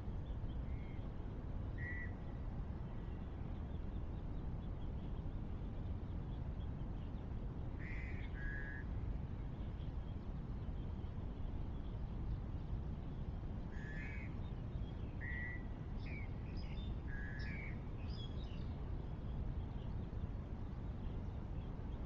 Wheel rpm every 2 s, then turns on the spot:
0, 0, 0, 0, 0, 0, 0, 0, 0, 0, 0.
none